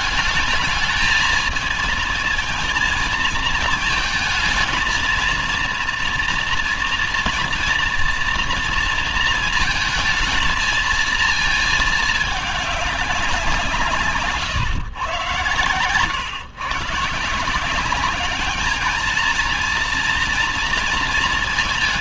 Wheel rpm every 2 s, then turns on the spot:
220, 220, 230, 240, 230, 220, 200, 120, 140, 210, 230.
none